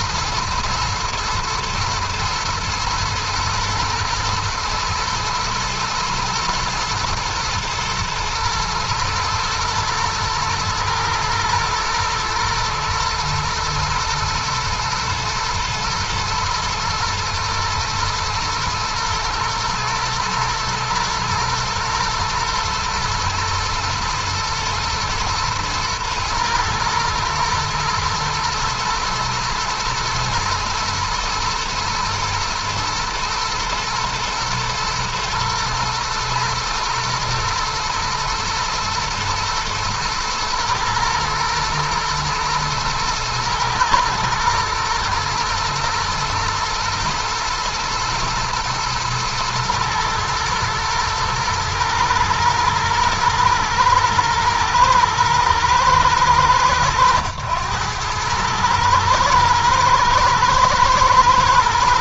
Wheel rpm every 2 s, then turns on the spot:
120, 110, 110, 120, 120, 110, 120, 110, 110, 110, 110, 110, 120, 120, 120, 110, 110, 110, 120, 110, 110, 110, 120, 120, 110, 110, 120, 110, 110, 110, 110.
none